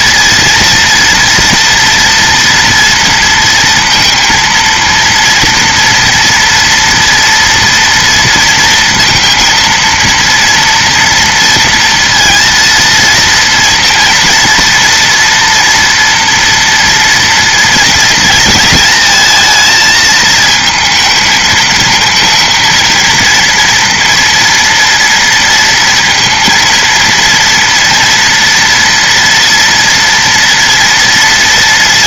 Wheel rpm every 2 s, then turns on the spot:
240, 240, 230, 230, 230, 230, 230, 230, 230, 230, 220, 230, 230, 230, 230, 230.
none